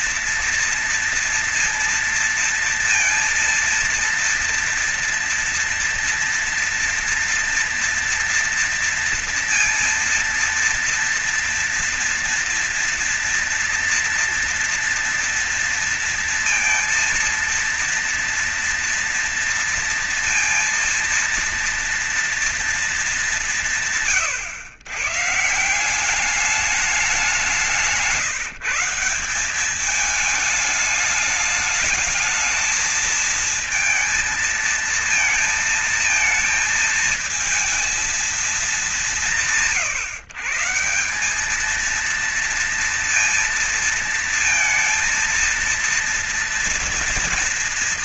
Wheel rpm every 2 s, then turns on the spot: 240, 230, 230, 230, 230, 230, 240, 240, 230, 230, 230, 220, 120, 190, 170, 220, 220, 230, 220, 190, 160, 230, 230, 230.
none